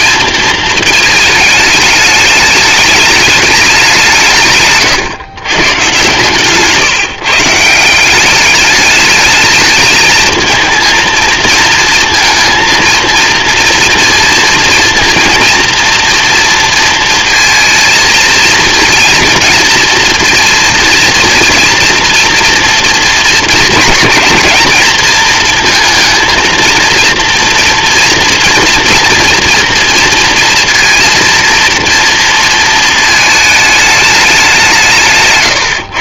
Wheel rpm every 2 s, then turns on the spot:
230, 210, 130, 140, 200, 230, 220, 230, 230, 230, 230, 230, 230, 230, 230, 230, 230, 180.
4-6